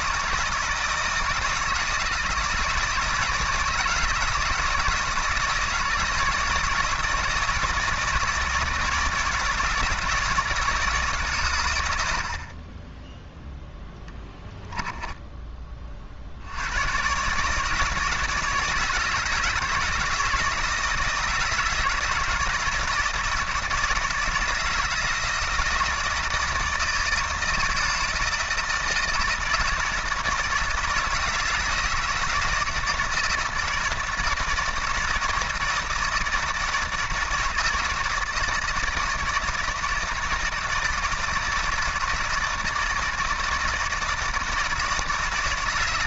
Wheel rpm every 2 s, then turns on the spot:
160, 160, 170, 160, 160, 160, 20, 10, 110, 160, 160, 160, 160, 160, 160, 160, 160, 160, 160, 160, 160, 160, 160.
none